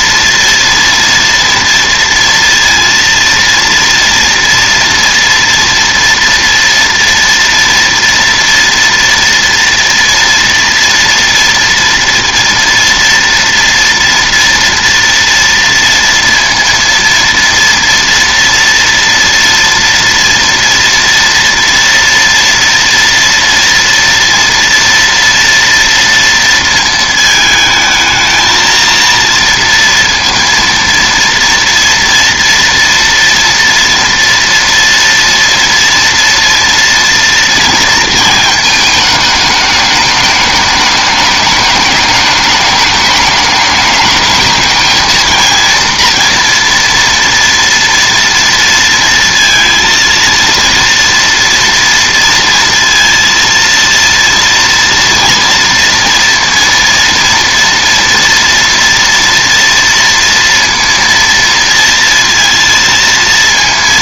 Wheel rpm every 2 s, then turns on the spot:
230, 230, 230, 230, 230, 230, 240, 230, 230, 230, 230, 230, 230, 220, 230, 230, 230, 230, 230, 220, 210, 210, 220, 230, 230, 230, 230, 230, 230, 230, 230, 230.
none